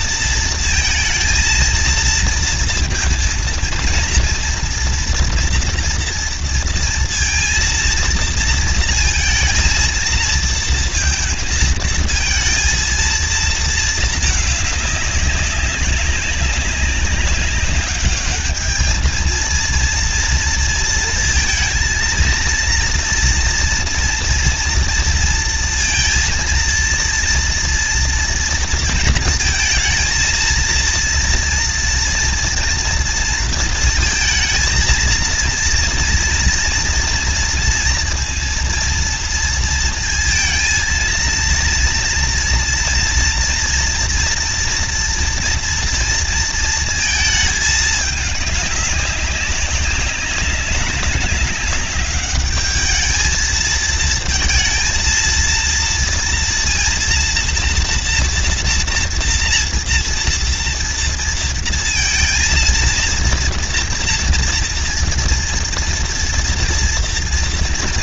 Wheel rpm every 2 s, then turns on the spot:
220, 230, 230, 230, 230, 230, 220, 210, 200, 210, 230, 230, 230, 230, 230, 230, 230, 230, 230, 230, 230, 230, 230, 230, 210, 200, 210, 230, 230, 230, 240, 230, 230, 230.
none